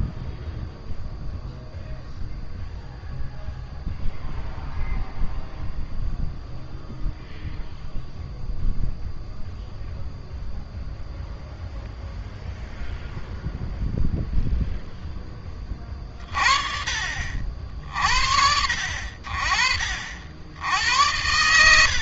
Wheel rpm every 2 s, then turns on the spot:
0, 0, 0, 0, 0, 0, 0, 0, 50, 70, 70.
none